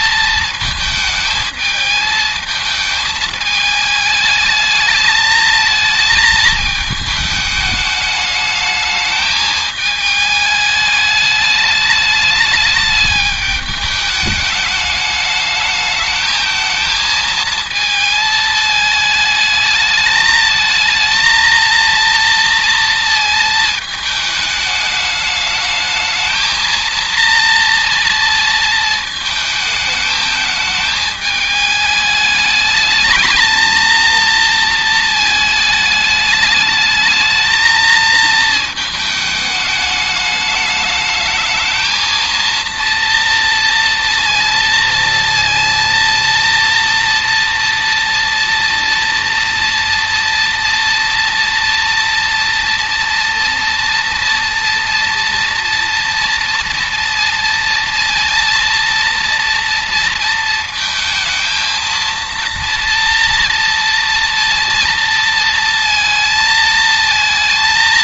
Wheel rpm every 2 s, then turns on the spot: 220, 220, 220, 220, 220, 210, 210, 210, 230, 220, 220, 230, 210, 230, 220, 210, 220, 230, 220, 220, 220, 230, 230, 230, 230, 230, 230, 230, 230, 230, 220, 230, 230, 220.
none